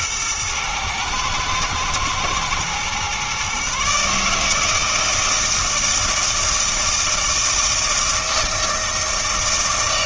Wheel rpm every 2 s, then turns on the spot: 110, 120, 150, 160, 160.
none